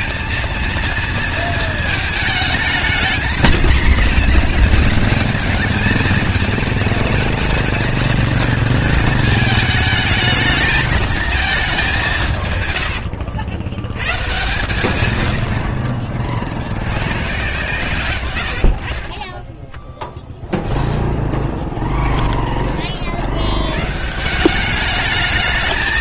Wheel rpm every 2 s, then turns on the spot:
230, 220, 230, 220, 230, 220, 110, 120, 60, 70, 0, 30, 190.
12-14